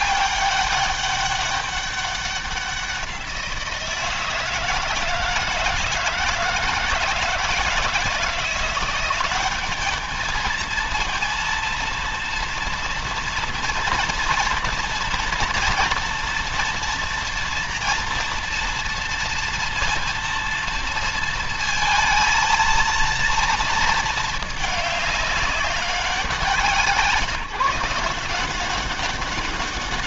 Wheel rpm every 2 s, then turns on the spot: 200, 180, 160, 160, 180, 220, 240, 230, 230, 240, 230, 230, 210, 170, 190.
none